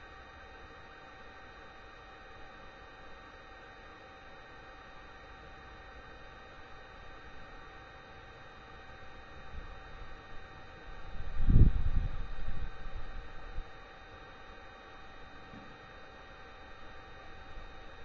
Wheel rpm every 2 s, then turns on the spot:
0, 0, 0, 0, 0, 0, 0, 0, 0.
none